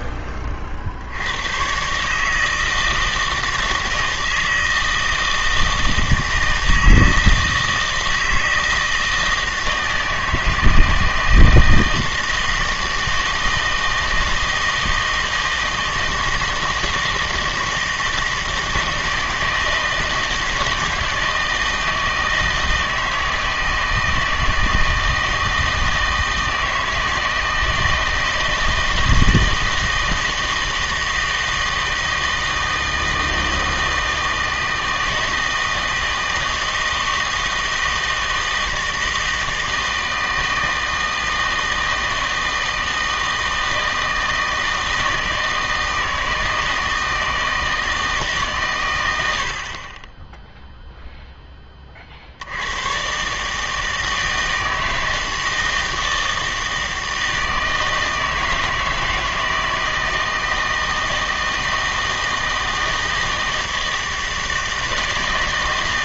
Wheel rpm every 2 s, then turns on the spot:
50, 160, 160, 160, 160, 160, 160, 160, 160, 160, 160, 160, 160, 160, 160, 160, 160, 160, 160, 160, 160, 160, 160, 160, 130, 0, 100, 160, 160, 160, 160, 160, 160.
none